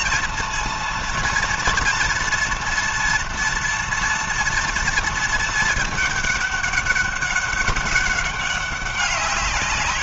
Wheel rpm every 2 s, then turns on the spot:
230, 230, 230, 200, 190.
none